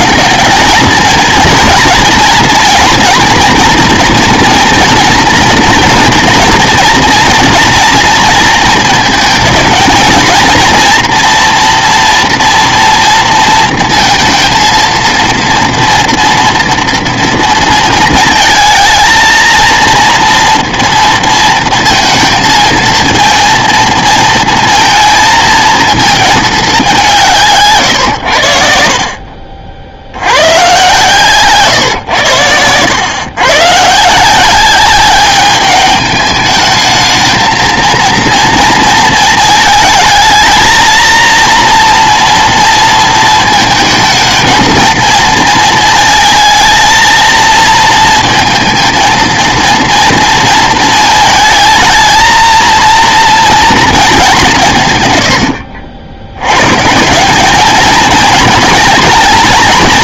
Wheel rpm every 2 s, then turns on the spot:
230, 240, 230, 230, 220, 230, 230, 230, 230, 220, 230, 230, 230, 200, 70, 120, 100, 190, 210, 230, 220, 230, 230, 220, 230, 220, 230, 150, 120, 230.
none